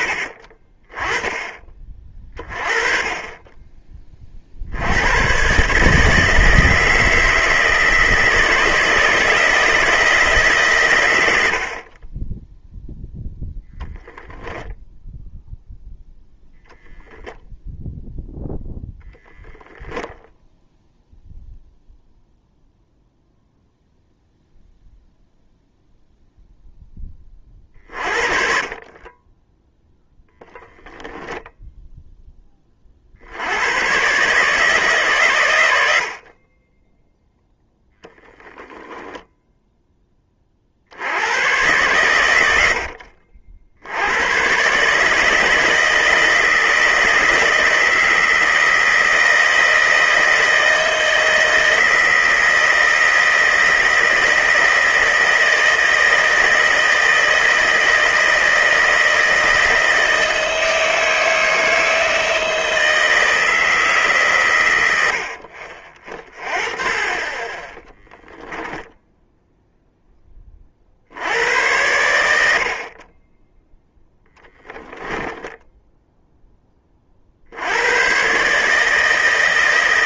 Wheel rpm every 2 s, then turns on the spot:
30, 20, 90, 170, 160, 120, 0, 0, 0, 0, 0, 0, 0, 10, 30, 0, 30, 140, 10, 0, 60, 60, 140, 160, 160, 160, 160, 160, 160, 160, 160, 160, 100, 30, 10, 50, 50, 10, 10, 150.
74-76